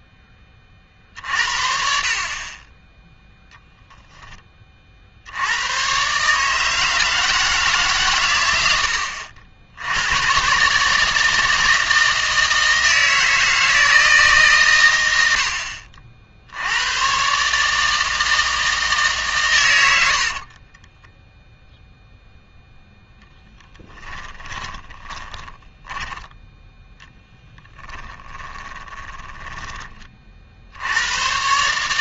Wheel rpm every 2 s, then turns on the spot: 30, 20, 40, 160, 90, 140, 160, 120, 100, 160, 20, 0, 20, 10, 20, 80.
20-22 24-26 28-30